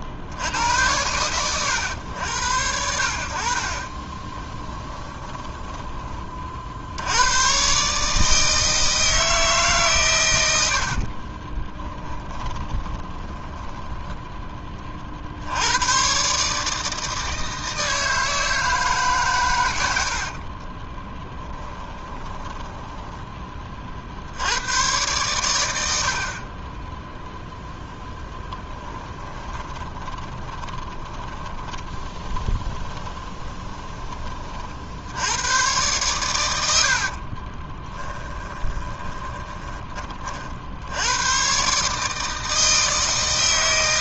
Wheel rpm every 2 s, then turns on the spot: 90, 70, 10, 60, 160, 70, 20, 30, 150, 150, 30, 10, 100, 10, 10, 30, 20, 50, 80, 20, 80, 160.
4-6 10-14 20-24 28-34 38-40